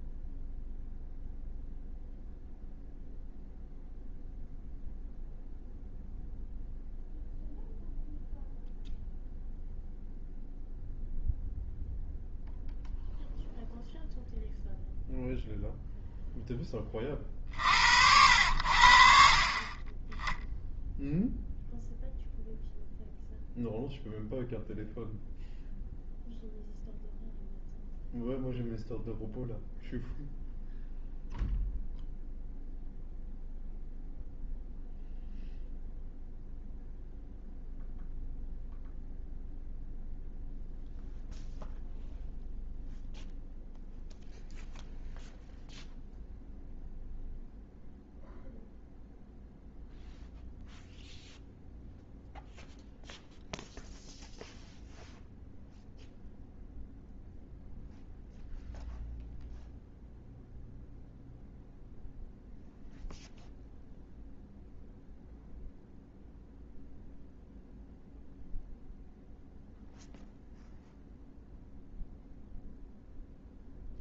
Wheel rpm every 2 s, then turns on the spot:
0, 0, 0, 0, 0, 0, 0, 0, 20, 60, 0, 0, 0, 0, 0, 0, 0, 0, 0, 0, 0, 0, 0, 0, 0, 0, 0, 0, 0, 0, 0, 0, 0, 0, 0, 0, 0.
none